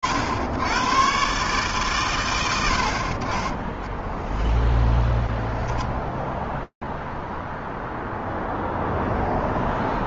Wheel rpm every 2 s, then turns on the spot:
90, 80, 0, 0, 0.
none